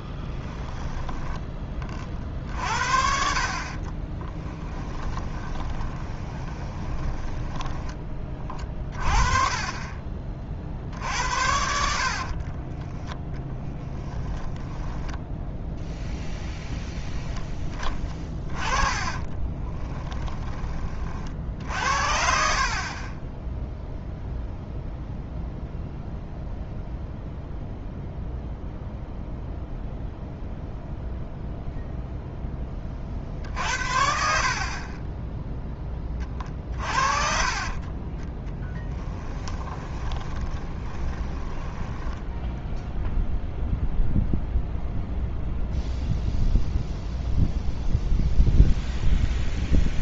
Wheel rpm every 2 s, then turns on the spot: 10, 50, 10, 20, 30, 50, 20, 10, 0, 20, 30, 40, 0, 0, 0, 0, 30, 30, 40, 10, 20, 0, 0, 0, 0.
0-2 4-8 12-16 18-20 38-42